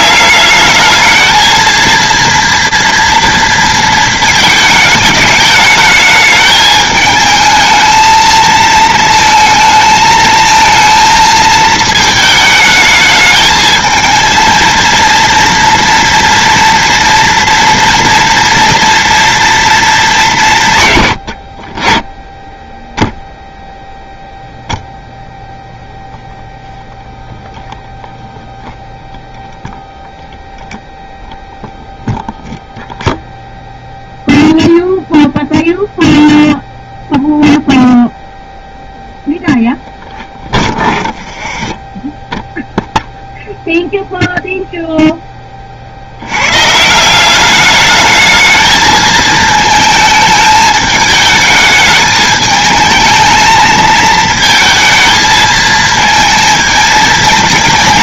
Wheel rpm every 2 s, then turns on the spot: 210, 230, 220, 220, 230, 220, 210, 230, 230, 230, 160, 10, 0, 0, 0, 0, 0, 0, 0, 0, 0, 0, 0, 130, 220, 210, 220, 230, 220.
none